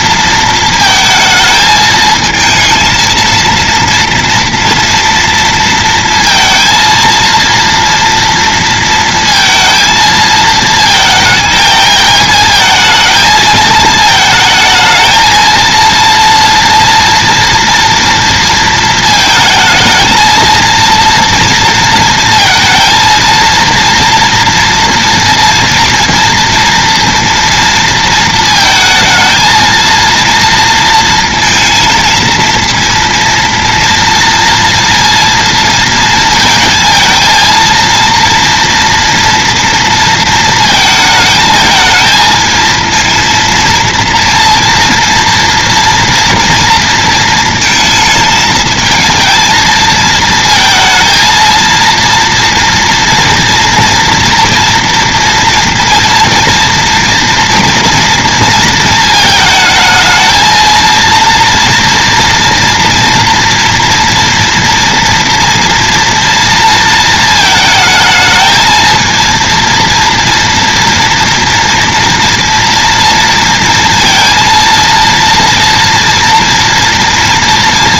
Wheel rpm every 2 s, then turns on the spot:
230, 230, 230, 230, 230, 220, 220, 220, 230, 230, 230, 230, 230, 230, 220, 230, 230, 230, 230, 230, 230, 220, 230, 230, 220, 230, 230, 240, 230, 230, 230, 230, 230, 230, 220, 230, 230, 230, 240.
none